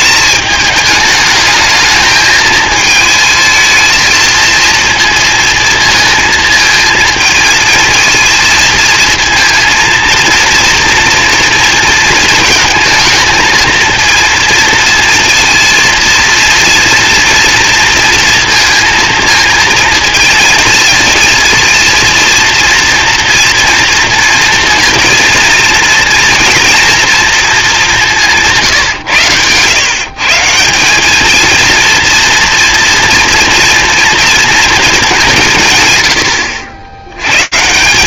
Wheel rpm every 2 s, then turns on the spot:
210, 220, 230, 220, 230, 230, 220, 230, 230, 230, 220, 230, 230, 230, 150, 180, 240, 220, 100.
none